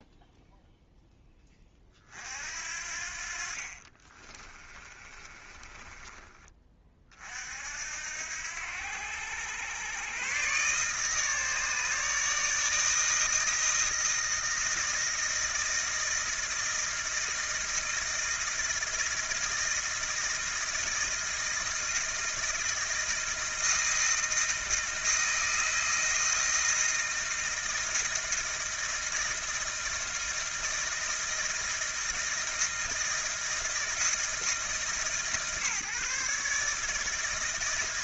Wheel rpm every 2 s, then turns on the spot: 0, 60, 30, 30, 90, 150, 160, 160, 160, 160, 160, 160, 160, 160, 160, 160, 160, 140, 160.
4-6